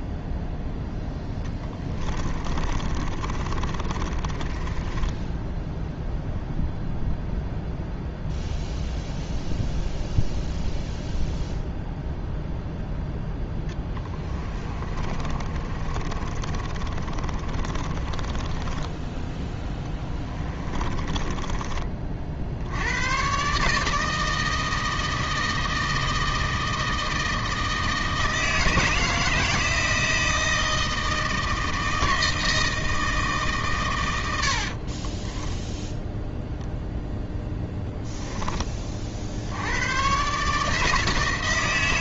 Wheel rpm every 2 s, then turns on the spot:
0, 30, 20, 0, 0, 0, 0, 30, 30, 20, 30, 100, 160, 160, 160, 160, 160, 30, 0, 20, 160.
2-6 14-22 34-36